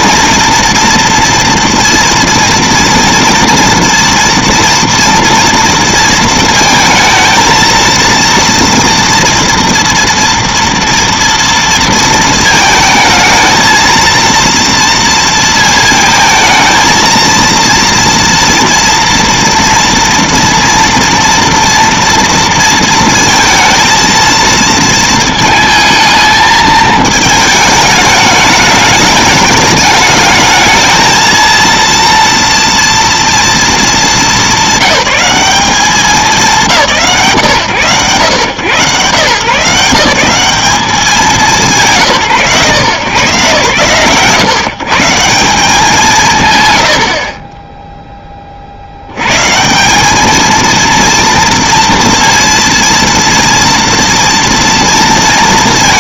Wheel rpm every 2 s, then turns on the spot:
230, 230, 230, 230, 230, 230, 220, 230, 220, 230, 240, 230, 220, 220, 210, 220, 230, 200, 210, 110, 190, 130, 150, 110, 50, 230, 230, 230.
none